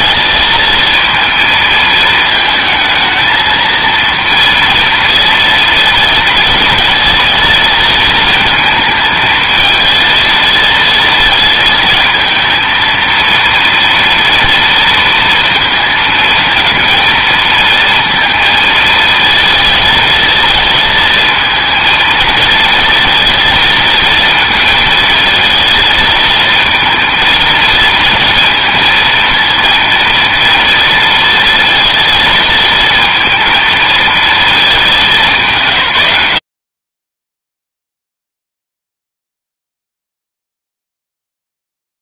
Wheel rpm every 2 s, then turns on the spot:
230, 220, 230, 230, 220, 230, 230, 230, 230, 230, 220, 230, 220, 220, 230, 230, 220, 210, 40, 0, 0.
none